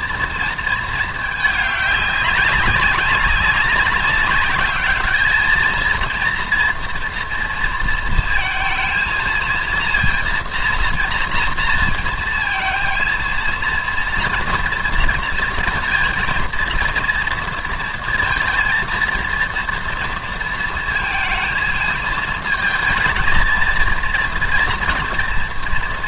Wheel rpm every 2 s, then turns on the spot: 230, 200, 200, 230, 230, 230, 230, 230, 230, 230, 230, 220, 230.
none